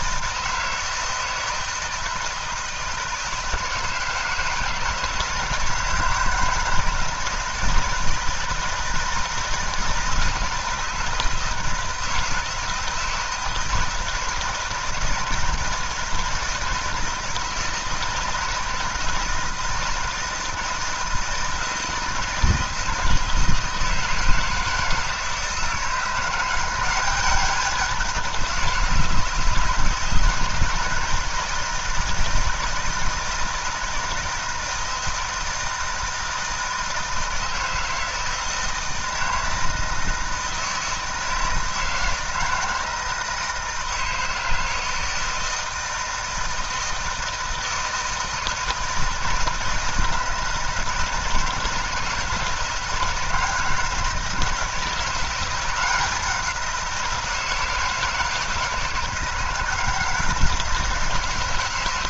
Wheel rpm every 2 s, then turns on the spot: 160, 160, 160, 160, 160, 160, 160, 160, 160, 170, 160, 160, 160, 190, 160, 160, 160, 160, 160, 160, 160, 160, 160, 160, 160, 160, 160, 170, 180, 160, 170.
none